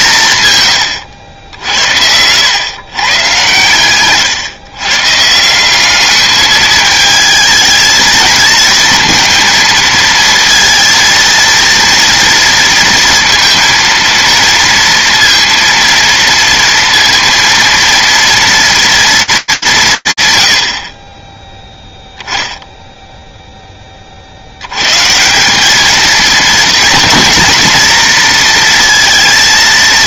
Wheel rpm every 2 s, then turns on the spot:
90, 120, 160, 220, 230, 230, 230, 230, 230, 220, 30, 0, 180, 230, 230.
none